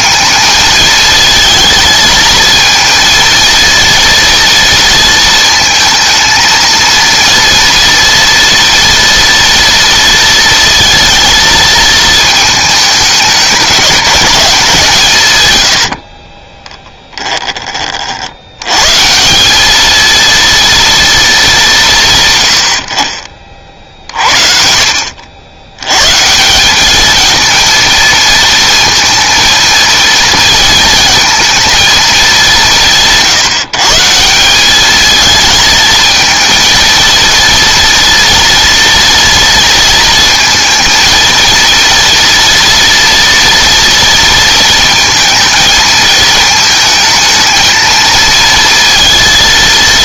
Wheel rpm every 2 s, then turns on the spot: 220, 230, 230, 230, 230, 230, 210, 170, 10, 110, 230, 60, 60, 200, 230, 230, 170, 200, 230, 230, 230, 240, 230, 220, 230.
16-18